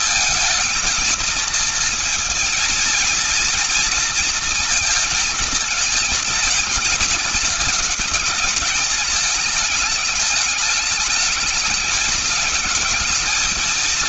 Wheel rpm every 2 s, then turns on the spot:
220, 230, 230, 220, 210, 210, 220.
none